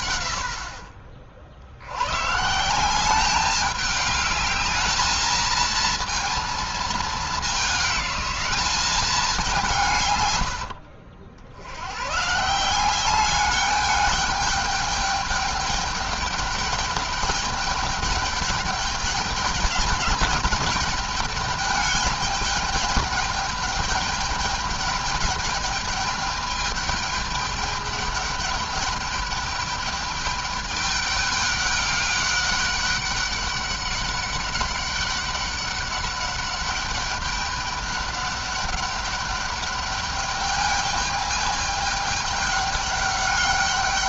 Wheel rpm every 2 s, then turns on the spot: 90, 160, 210, 220, 200, 90, 160, 210, 210, 210, 210, 210, 210, 210, 210, 210, 200, 200, 200, 200, 210, 200.
10-12